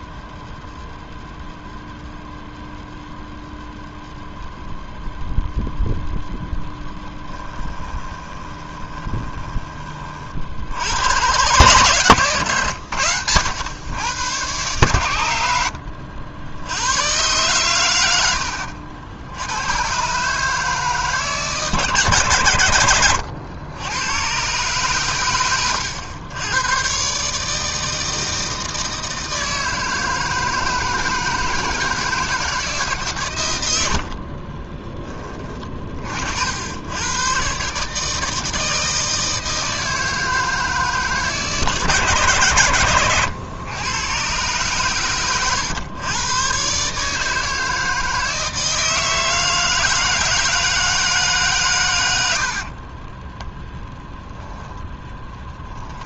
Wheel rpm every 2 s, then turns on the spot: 0, 0, 0, 10, 20, 80, 100, 110, 100, 70, 150, 110, 120, 120, 160, 160, 150, 30, 90, 160, 150, 120, 120, 140, 160, 160, 50, 10.
6-10 34-36 52-56